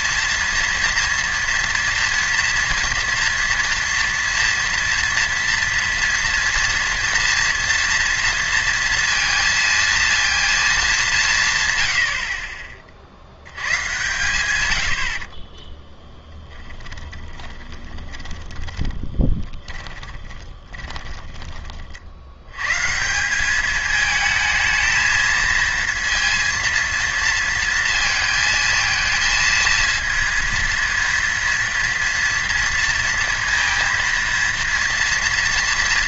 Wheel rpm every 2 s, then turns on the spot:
240, 230, 230, 230, 230, 230, 40, 110, 20, 10, 20, 110, 220, 230, 220, 230, 230, 230.
16-22